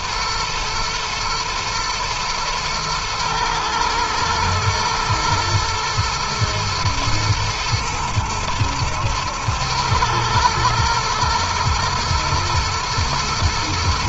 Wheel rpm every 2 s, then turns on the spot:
110, 110, 120, 110, 110, 120, 110.
none